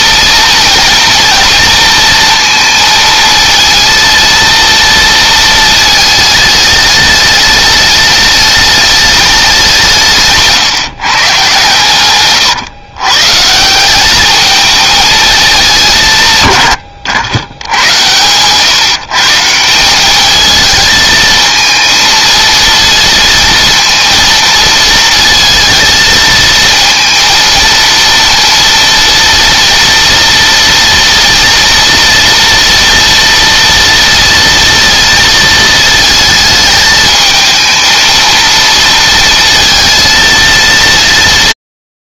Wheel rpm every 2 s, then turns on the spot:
230, 230, 230, 210, 210, 150, 120, 220, 100, 140, 220, 230, 230, 230, 230, 230, 230, 230, 220, 230, 190.
none